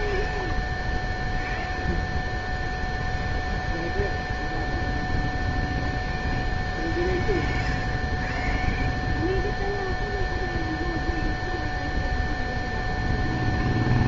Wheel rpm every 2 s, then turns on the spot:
0, 0, 0, 0, 0, 0, 0.
none